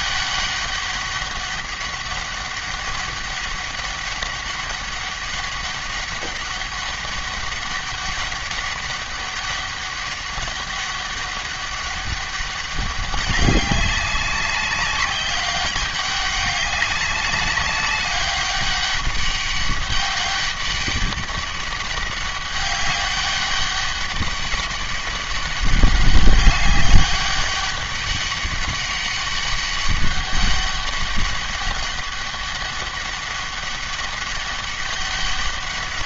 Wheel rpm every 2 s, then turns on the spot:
200, 200, 200, 200, 200, 200, 200, 190, 200, 200, 200, 200, 200, 200, 200, 200, 200, 200.
none